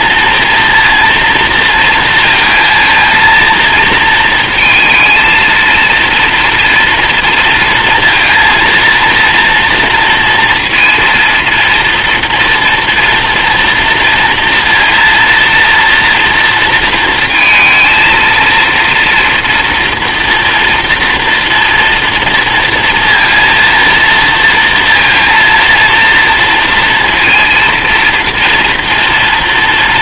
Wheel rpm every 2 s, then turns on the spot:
230, 230, 230, 230, 230, 230, 230, 230, 230, 230, 230, 230, 230, 230, 230.
none